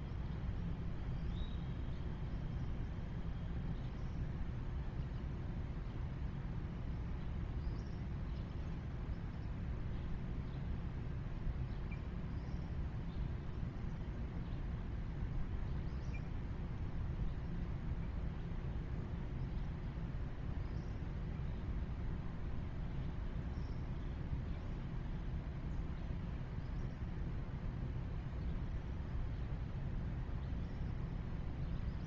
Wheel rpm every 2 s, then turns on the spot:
0, 0, 0, 0, 0, 0, 0, 0, 0, 0, 0, 0, 0, 0, 0, 0.
none